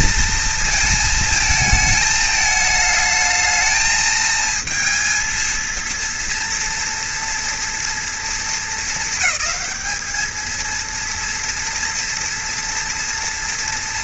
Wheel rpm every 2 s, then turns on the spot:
220, 210, 230, 230, 220, 230, 240.
none